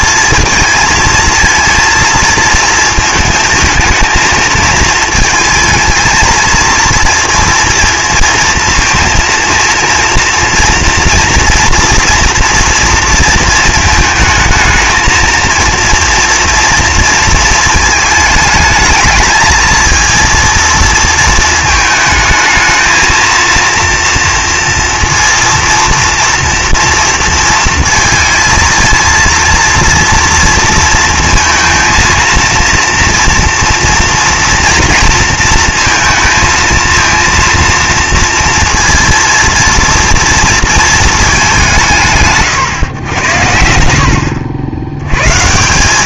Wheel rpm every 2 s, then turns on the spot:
230, 230, 220, 230, 220, 230, 230, 220, 230, 220, 230, 220, 240, 230, 230, 230, 230, 230, 230, 230, 230, 130, 80.
none